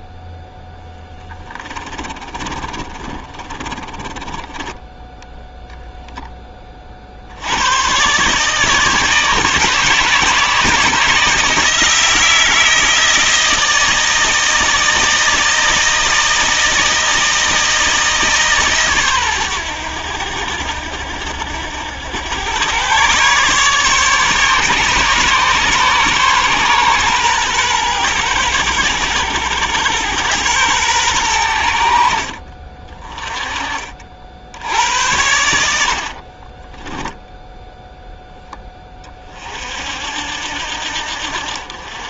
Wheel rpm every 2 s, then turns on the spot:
10, 30, 10, 50, 160, 160, 160, 160, 160, 130, 60, 120, 140, 130, 110, 110, 30, 90, 10, 30, 70.
0-4 36-38